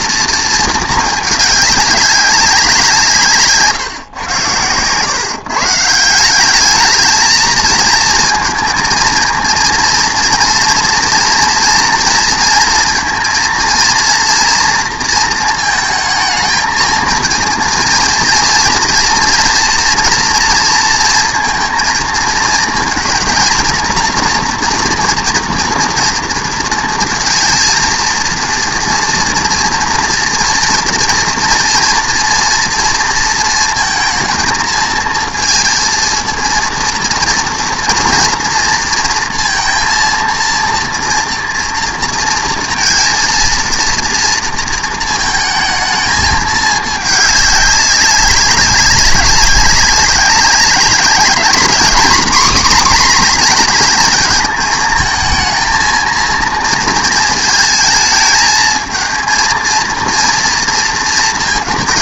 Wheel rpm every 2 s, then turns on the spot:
220, 170, 110, 210, 230, 230, 230, 230, 220, 230, 230, 230, 240, 230, 230, 240, 230, 230, 230, 230, 230, 230, 220, 210, 190, 200, 250, 220, 230, 220, 230.
none